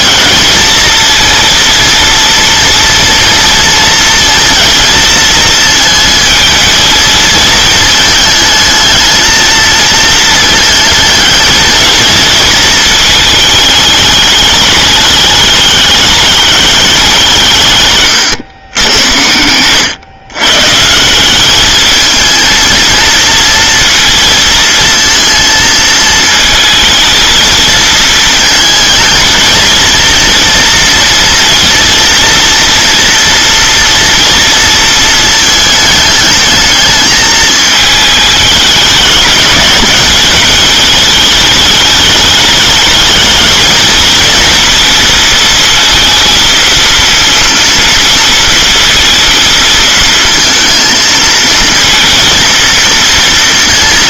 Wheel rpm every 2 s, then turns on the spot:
220, 230, 230, 220, 220, 230, 220, 210, 200, 110, 130, 230, 230, 220, 230, 230, 230, 230, 220, 210, 210, 210, 230, 230, 230, 230, 230.
none